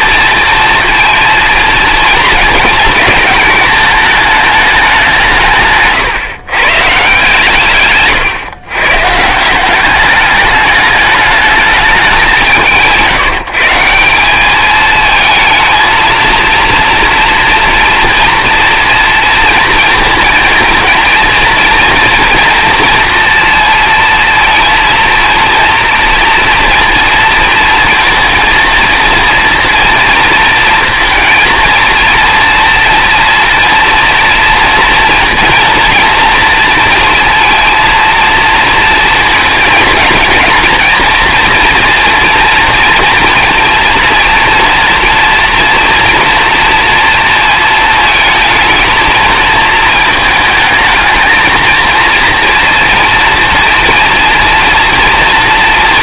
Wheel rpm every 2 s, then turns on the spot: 230, 210, 210, 130, 130, 210, 160, 210, 230, 230, 230, 230, 230, 230, 230, 230, 230, 230, 230, 230, 230, 230, 230, 230, 220, 220, 230, 230.
none